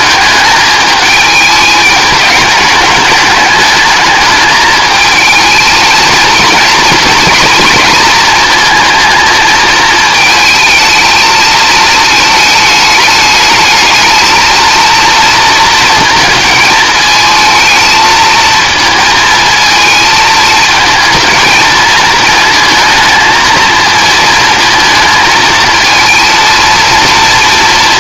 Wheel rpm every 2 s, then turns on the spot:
210, 210, 210, 240, 230, 220, 210, 220, 220, 220, 220, 230, 220, 230.
none